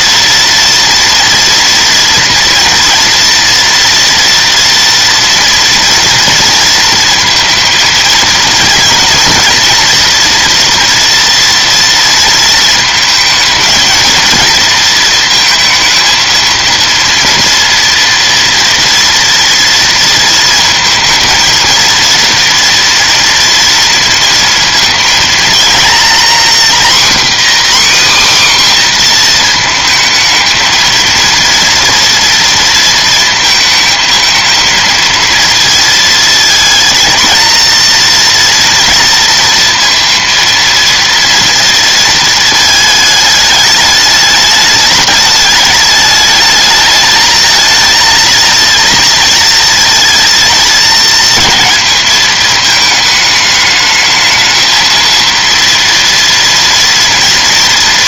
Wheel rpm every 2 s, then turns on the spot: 240, 230, 230, 230, 230, 230, 220, 230, 230, 230, 220, 230, 230, 250, 260, 230, 230, 220, 230, 240, 230, 220, 210, 210, 230, 220, 220, 220, 240.
none